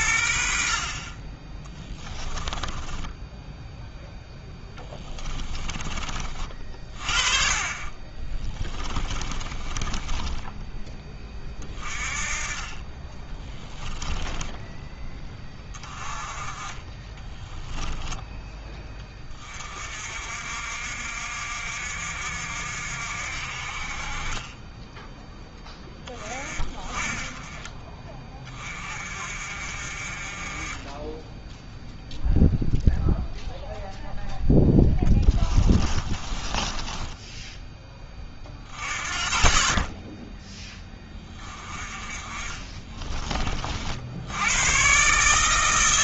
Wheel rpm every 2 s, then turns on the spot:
50, 20, 10, 40, 20, 10, 30, 10, 30, 20, 60, 60, 10, 30, 30, 20, 0, 10, 20, 30, 20, 20, 120.
2-6 8-10 34-38 42-44